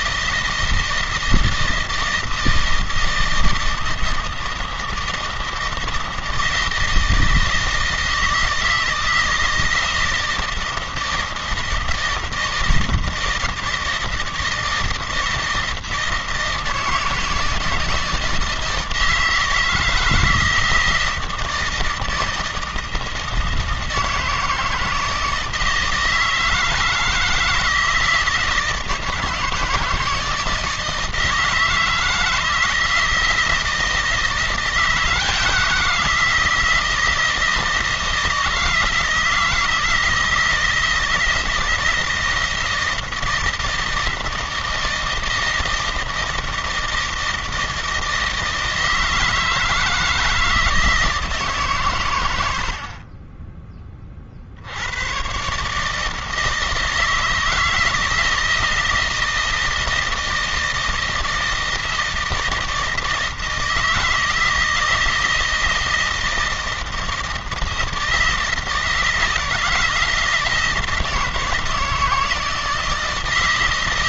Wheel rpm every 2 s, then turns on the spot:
160, 160, 160, 160, 160, 160, 160, 160, 170, 160, 160, 160, 160, 160, 160, 170, 160, 170, 170, 160, 160, 160, 160, 160, 160, 160, 80, 70, 160, 160, 160, 160, 160, 160, 160, 160, 160.
none